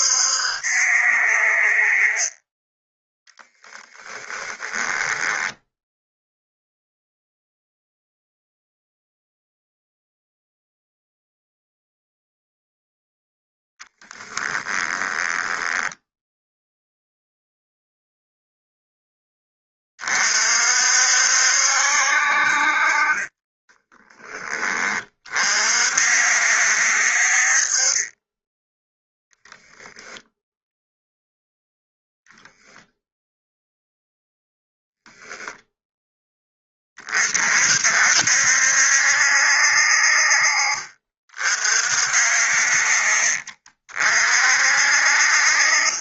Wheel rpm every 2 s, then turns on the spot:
60, 10, 10, 0, 0, 0, 0, 10, 0, 0, 60, 40, 30, 60, 10, 0, 0, 0, 30, 70, 40, 40, 50.
4-6 14-16 22-24 28-30